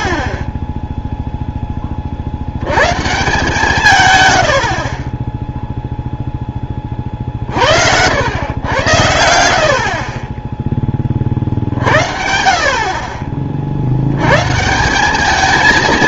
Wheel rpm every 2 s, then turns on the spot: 10, 100, 70, 20, 100, 10, 50, 150.
none